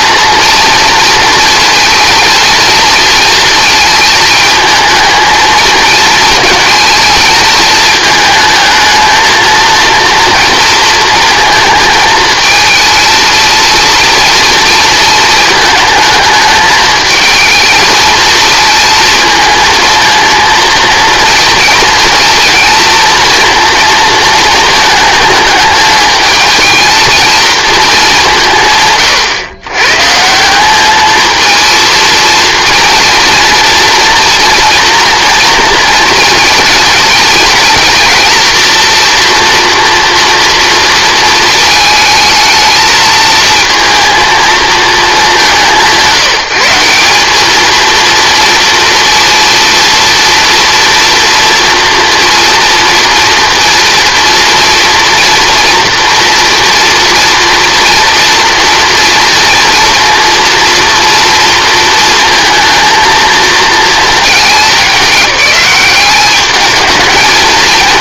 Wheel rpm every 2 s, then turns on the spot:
230, 230, 220, 220, 220, 230, 220, 230, 220, 230, 230, 230, 220, 220, 160, 190, 230, 240, 220, 230, 230, 220, 220, 170, 230, 230, 230, 230, 230, 230, 230, 230, 210, 210.
none